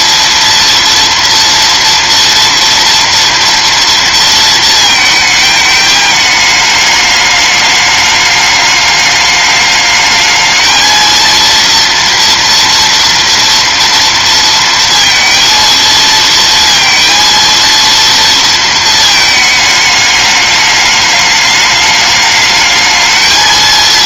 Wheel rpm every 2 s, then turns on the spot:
230, 230, 220, 210, 210, 230, 230, 230, 230, 220, 210, 220.
none